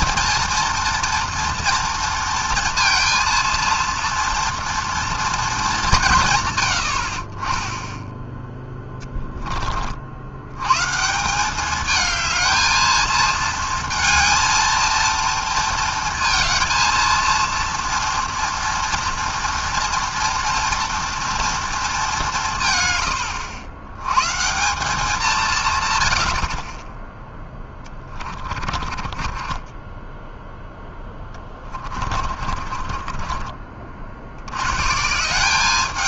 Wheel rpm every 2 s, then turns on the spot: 230, 230, 230, 40, 10, 190, 220, 230, 230, 230, 230, 100, 180, 10, 20, 20, 40, 180.
28-34